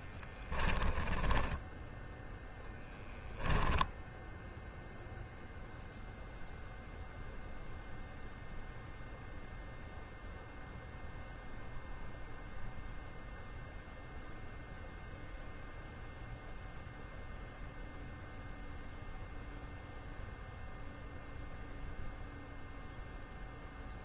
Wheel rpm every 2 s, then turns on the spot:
10, 0, 0, 0, 0, 0, 0, 0, 0, 0, 0, 0.
0-2